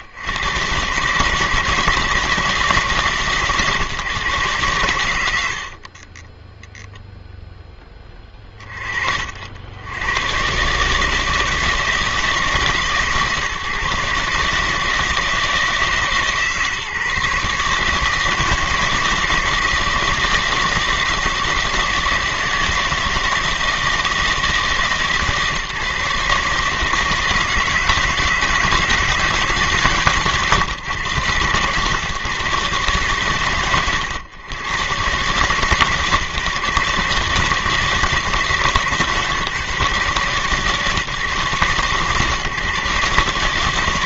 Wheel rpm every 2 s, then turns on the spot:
120, 160, 130, 10, 30, 130, 160, 150, 140, 160, 160, 160, 150, 140, 160, 130, 120, 110, 150, 150, 140, 140.
6-8